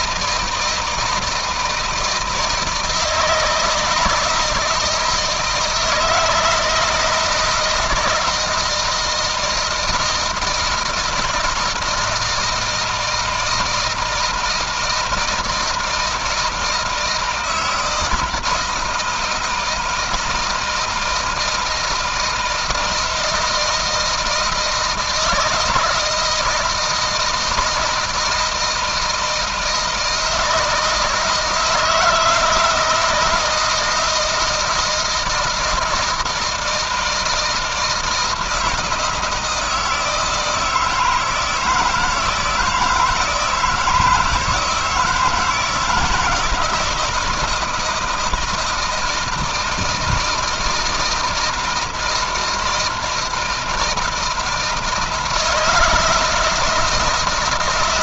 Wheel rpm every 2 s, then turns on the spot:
160, 160, 160, 170, 160, 160, 160, 160, 160, 170, 160, 160, 160, 160, 160, 160, 160, 160, 170, 160, 160, 160, 160, 160, 160, 160, 160, 160, 160.
none